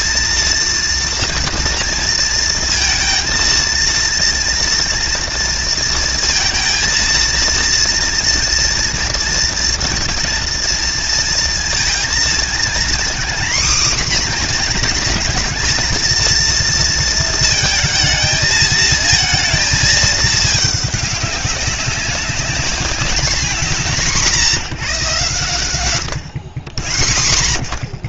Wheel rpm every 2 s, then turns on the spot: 230, 220, 230, 230, 230, 230, 240, 240, 230, 220, 210, 210, 170, 100.
none